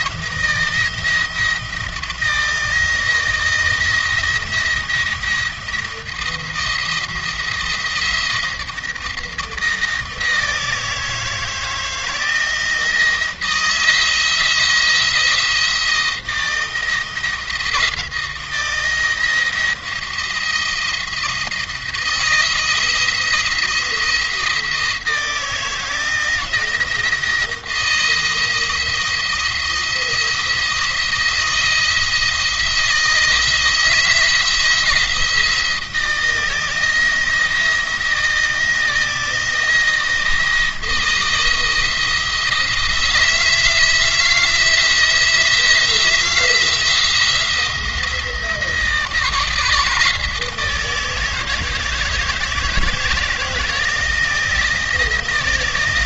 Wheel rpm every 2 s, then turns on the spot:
170, 160, 170, 160, 160, 160, 160, 170, 160, 170, 170, 170, 160, 170, 170, 170, 160, 170, 160, 170, 160, 170, 170, 170, 160, 160, 160, 170.
none